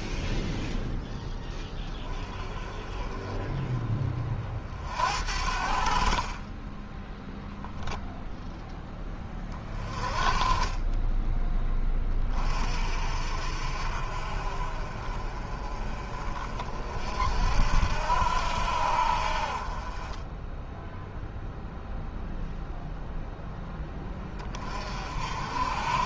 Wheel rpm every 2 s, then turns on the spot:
0, 20, 50, 20, 10, 20, 40, 40, 50, 70, 10, 0, 40.
none